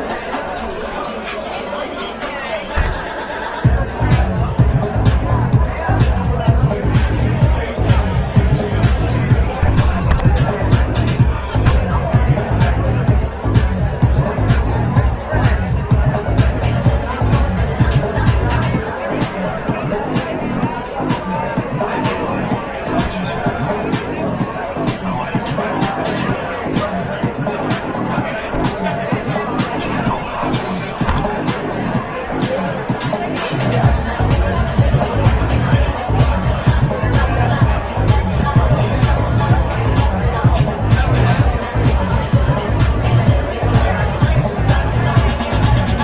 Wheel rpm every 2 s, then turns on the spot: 0, 0, 0, 20, 30, 20, 0, 0, 0, 0, 0, 0, 0, 0, 0, 10, 0, 0, 0, 0, 0, 0, 0.
none